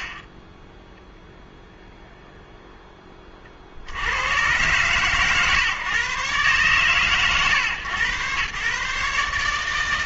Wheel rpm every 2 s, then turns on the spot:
20, 0, 120, 130, 130.
none